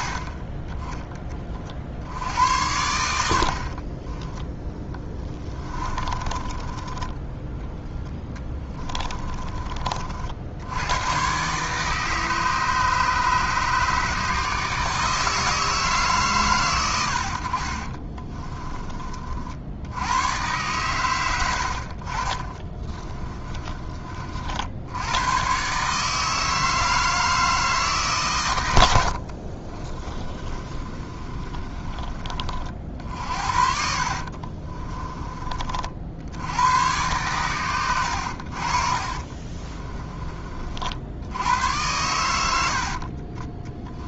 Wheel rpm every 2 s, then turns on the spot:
30, 90, 10, 20, 20, 100, 150, 160, 90, 20, 110, 20, 70, 160, 90, 30, 50, 50, 100, 50, 50, 60.
4-10 22-24 30-32 34-36 38-40 42-44